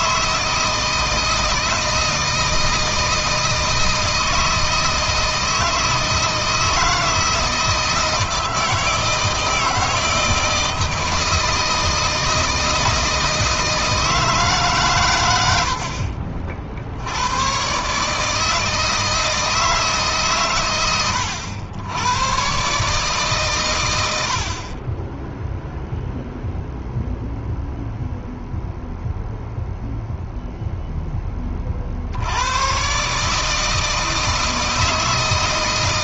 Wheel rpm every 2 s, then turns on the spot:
160, 160, 160, 160, 160, 160, 160, 130, 80, 160, 100, 140, 20, 0, 0, 10, 130, 160.
none